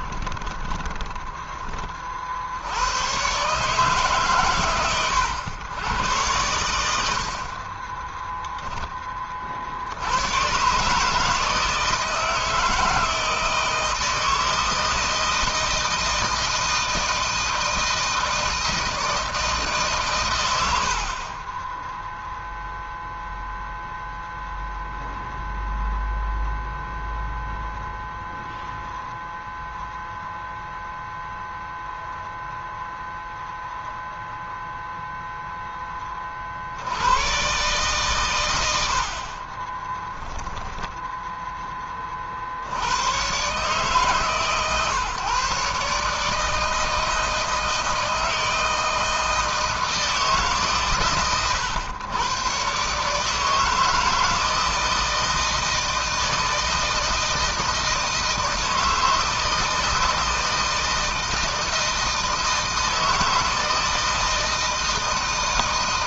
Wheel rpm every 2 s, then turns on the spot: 20, 100, 120, 90, 20, 140, 160, 160, 160, 160, 60, 0, 0, 0, 0, 0, 0, 0, 80, 80, 0, 100, 140, 160, 160, 140, 140, 160, 160, 160, 160, 160, 160.
0-2